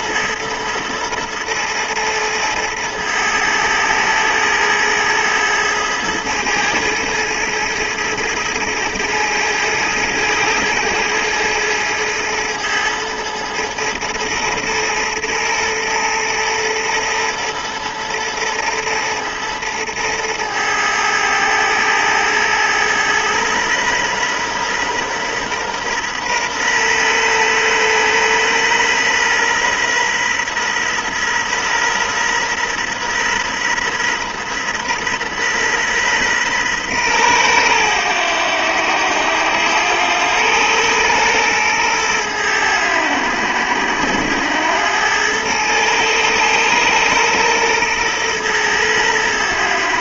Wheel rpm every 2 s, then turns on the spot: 110, 110, 110, 110, 110, 110, 110, 110, 110, 110, 110, 110, 120, 120, 120, 120, 120, 120, 120, 100, 110, 90, 100, 120, 110.
none